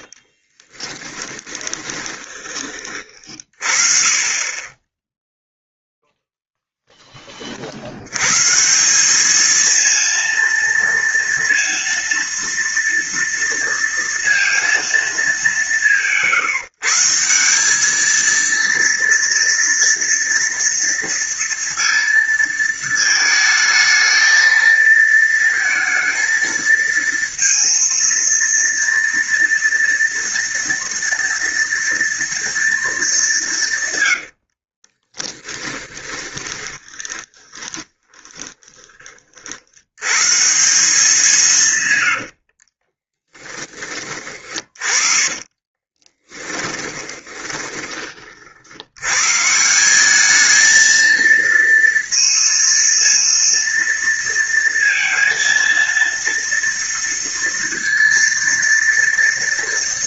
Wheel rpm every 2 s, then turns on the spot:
20, 30, 10, 10, 200, 230, 230, 190, 170, 230, 230, 220, 230, 230, 230, 230, 210, 20, 20, 30, 190, 40, 30, 20, 70, 220, 230, 230, 230, 230.
0-2 34-38 42-48